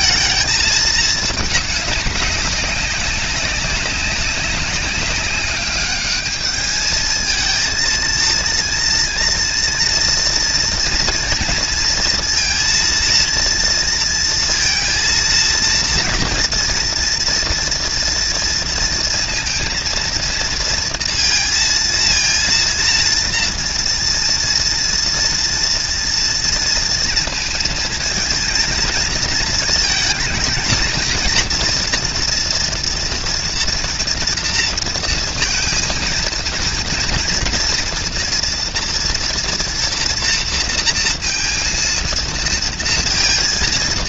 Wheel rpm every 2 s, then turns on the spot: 220, 210, 190, 200, 230, 230, 230, 230, 230, 230, 230, 230, 230, 240, 220, 220, 230, 230, 230, 230, 240, 230.
none